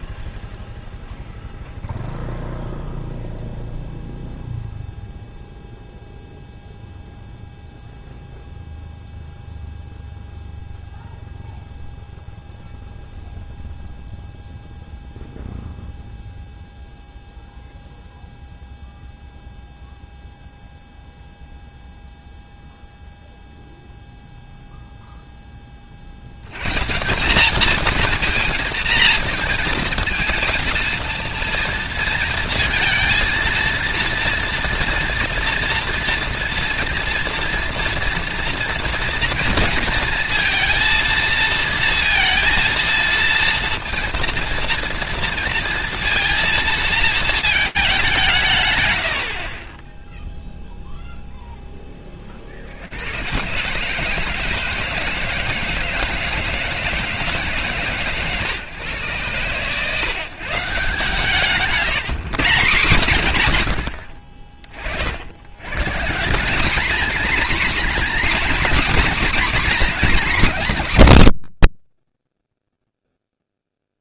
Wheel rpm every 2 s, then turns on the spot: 0, 0, 0, 0, 0, 0, 0, 0, 0, 0, 0, 0, 0, 180, 230, 230, 230, 230, 230, 230, 230, 230, 230, 230, 100, 0, 110, 160, 150, 130, 160, 120, 90, 240, 250, 190, 0.
none